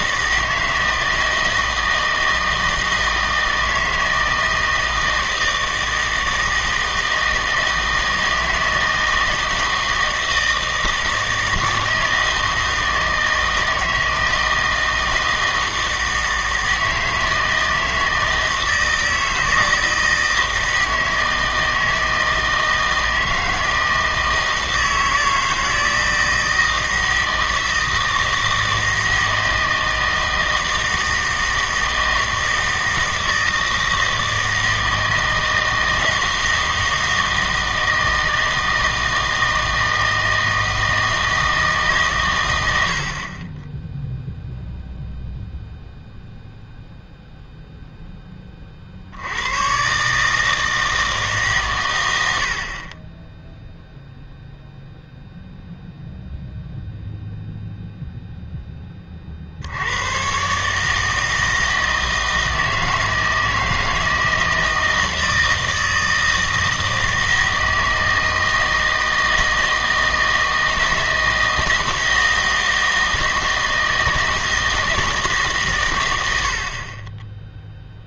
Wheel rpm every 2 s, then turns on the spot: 160, 160, 160, 160, 160, 160, 160, 160, 160, 160, 160, 160, 160, 160, 160, 160, 160, 160, 160, 160, 160, 100, 0, 0, 30, 160, 60, 0, 0, 10, 140, 160, 160, 160, 160, 160, 160, 160, 60.
none